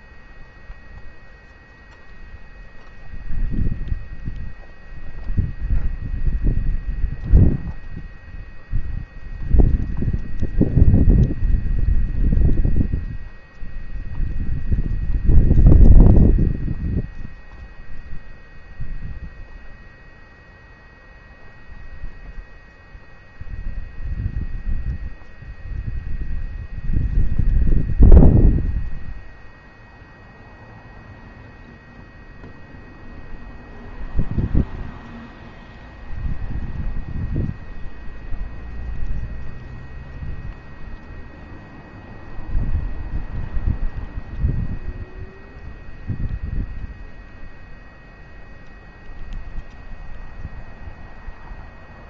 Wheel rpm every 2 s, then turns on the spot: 0, 0, 0, 0, 0, 0, 0, 0, 0, 0, 0, 0, 0, 0, 0, 0, 0, 0, 0, 0, 0, 0, 0, 0, 0, 0.
none